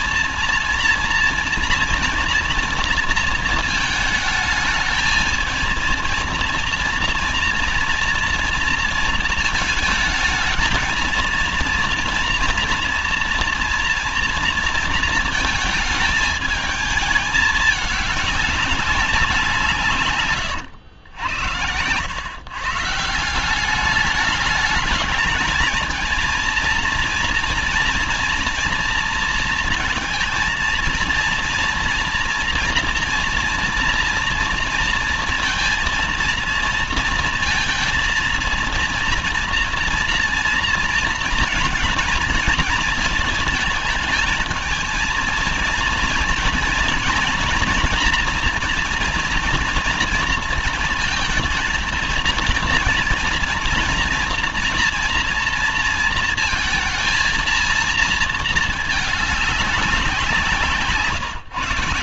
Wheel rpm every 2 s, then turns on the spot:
230, 230, 220, 230, 230, 220, 230, 230, 220, 210, 120, 130, 210, 230, 230, 230, 230, 230, 230, 230, 230, 230, 220, 230, 230, 230, 230, 230, 220, 220, 170.
none